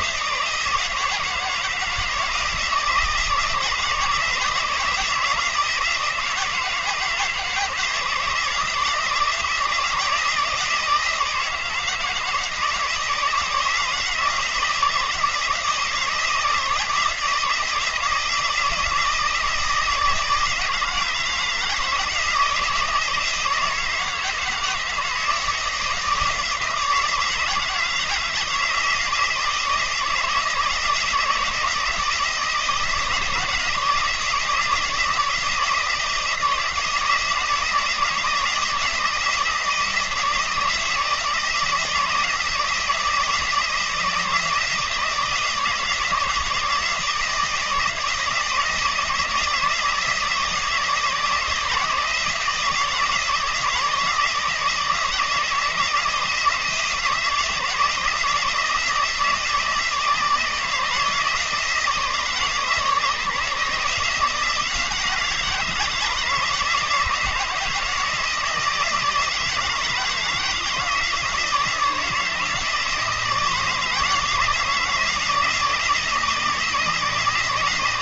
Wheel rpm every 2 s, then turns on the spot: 160, 160, 160, 160, 160, 160, 160, 160, 160, 160, 160, 160, 160, 160, 160, 160, 160, 160, 160, 160, 160, 170, 160, 160, 170, 160, 170, 160, 160, 160, 160, 150, 170, 160, 160, 160, 160, 160, 160.
none